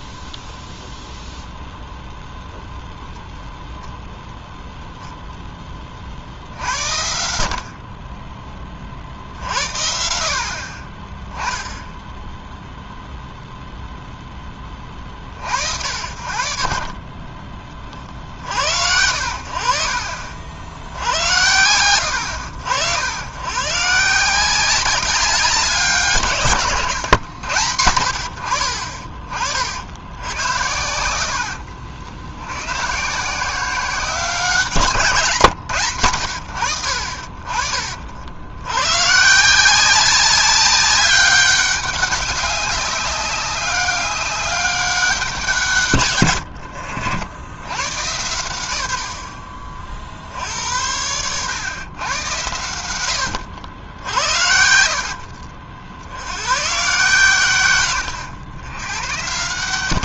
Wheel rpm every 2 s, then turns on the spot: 0, 0, 0, 70, 30, 40, 0, 20, 50, 70, 70, 80, 190, 140, 60, 80, 110, 160, 80, 100, 200, 200, 200, 80, 90, 80, 90, 80, 120, 100.
54-56